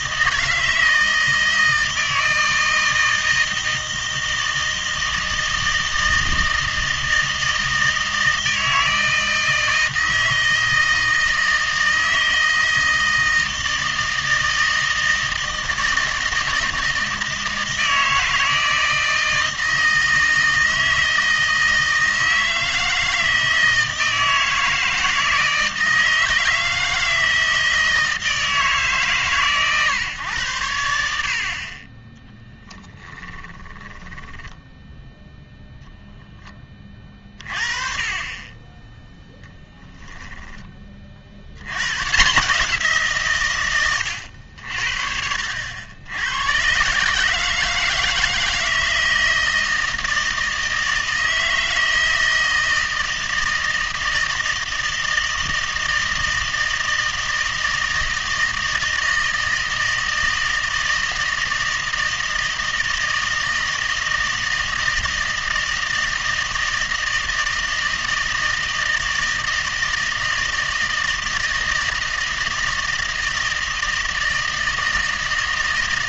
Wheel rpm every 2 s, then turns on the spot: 160, 160, 160, 160, 160, 160, 160, 160, 160, 160, 160, 160, 160, 160, 160, 100, 10, 0, 20, 20, 20, 170, 60, 120, 160, 160, 160, 160, 160, 160, 160, 160, 160, 160, 160, 160, 160, 160.
32-34